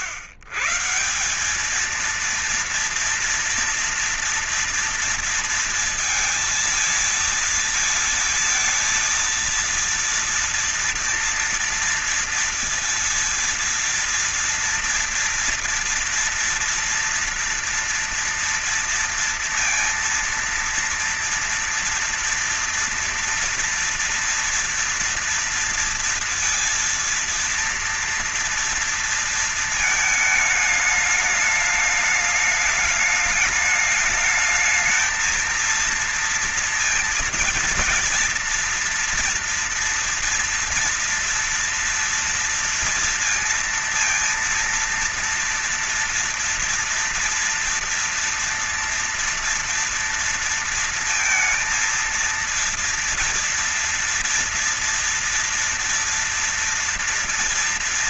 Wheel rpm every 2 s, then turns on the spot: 130, 230, 230, 230, 220, 230, 230, 230, 240, 240, 230, 230, 230, 230, 230, 220, 210, 220, 230, 230, 230, 230, 230, 230, 230, 230, 230, 230, 230.
none